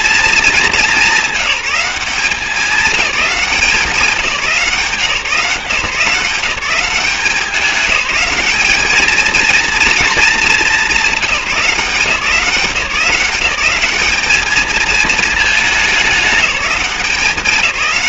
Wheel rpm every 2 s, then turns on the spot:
210, 200, 160, 180, 210, 220, 180, 220, 200.
none